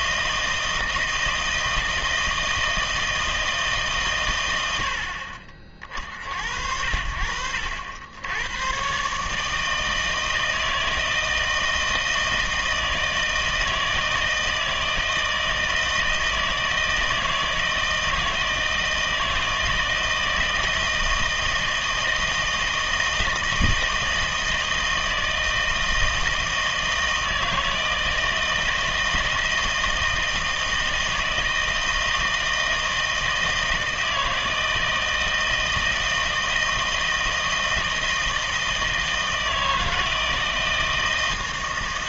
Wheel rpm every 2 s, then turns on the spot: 160, 160, 90, 70, 120, 160, 160, 160, 160, 160, 160, 160, 160, 160, 160, 160, 160, 160, 160, 160, 160.
none